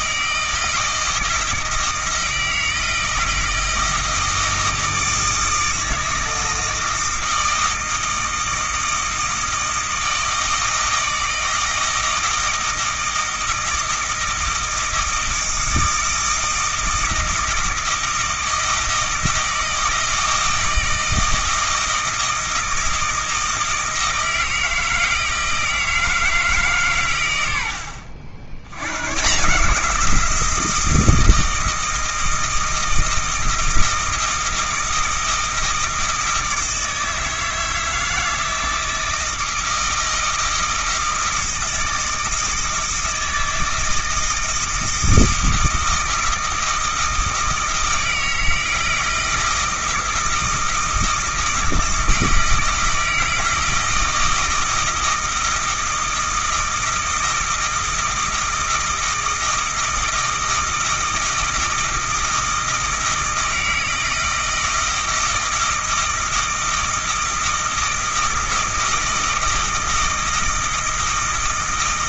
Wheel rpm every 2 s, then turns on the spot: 160, 160, 160, 160, 160, 160, 160, 160, 160, 160, 160, 160, 160, 150, 100, 170, 160, 160, 160, 160, 160, 160, 160, 160, 160, 160, 160, 160, 160, 160, 160, 160, 160, 160, 160, 160.
none